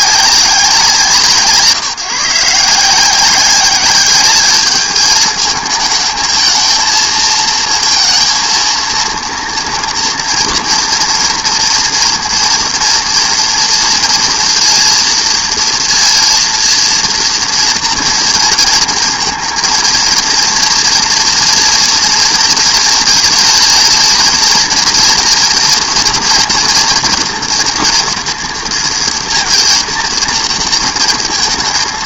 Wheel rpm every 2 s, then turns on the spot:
180, 160, 210, 220, 230, 230, 230, 230, 230, 230, 230, 230, 230, 240, 230, 230.
none